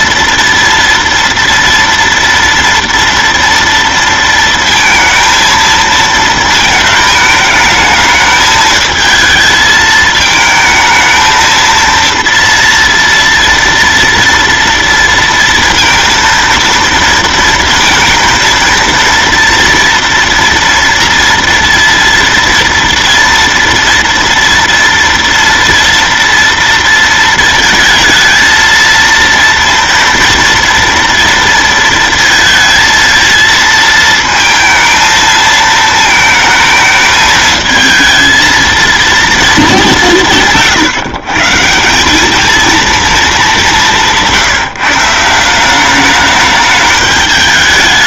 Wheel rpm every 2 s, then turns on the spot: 230, 230, 230, 220, 220, 220, 230, 230, 230, 230, 230, 230, 230, 230, 230, 230, 230, 230, 220, 230, 150, 220, 160, 210.
none